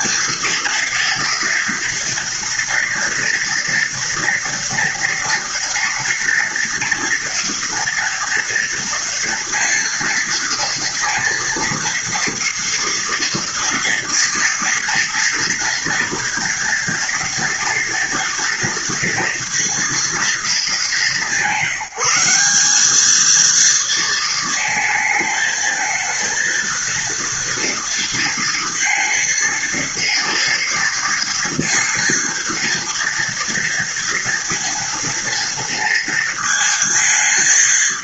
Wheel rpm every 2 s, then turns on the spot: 240, 230, 230, 230, 230, 230, 230, 230, 230, 230, 190, 210, 220, 230, 230, 240, 230, 230, 220.
none